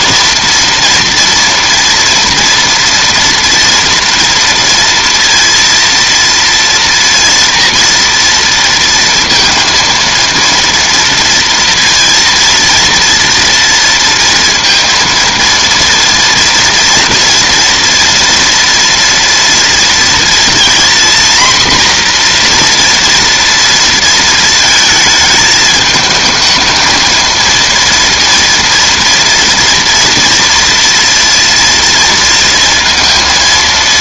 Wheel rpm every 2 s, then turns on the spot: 230, 230, 230, 230, 230, 230, 230, 230, 230, 230, 230, 240, 220, 220, 230, 230, 230.
none